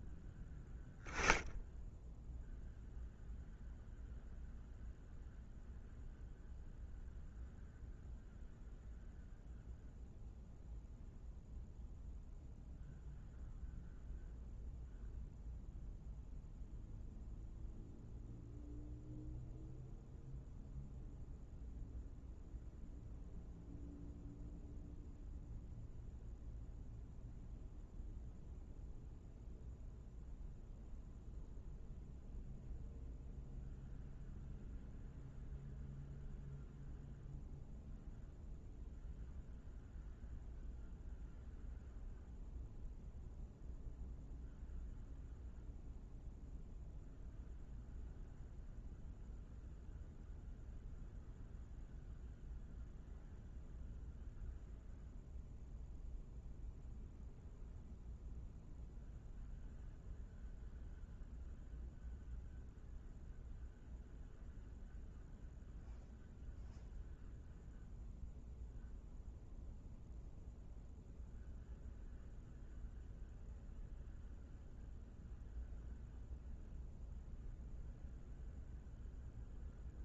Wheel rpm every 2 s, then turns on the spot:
0, 0, 0, 0, 0, 0, 0, 0, 0, 0, 0, 0, 0, 0, 0, 0, 0, 0, 0, 0, 0, 0, 0, 0, 0, 0, 0, 0, 0, 0, 0, 0, 0, 0, 0, 0, 0, 0, 0, 0.
none